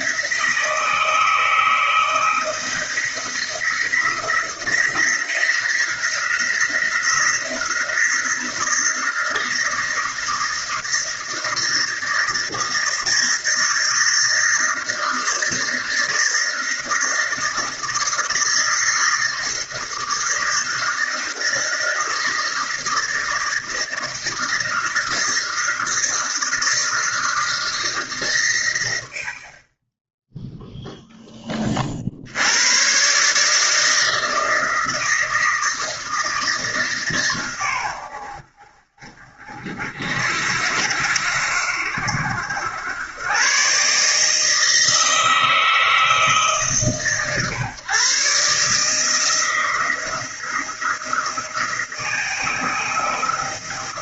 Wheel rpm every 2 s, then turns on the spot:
160, 160, 170, 170, 170, 160, 160, 160, 160, 160, 160, 160, 160, 160, 100, 0, 130, 160, 150, 50, 60, 100, 160, 140, 160, 160, 160.
none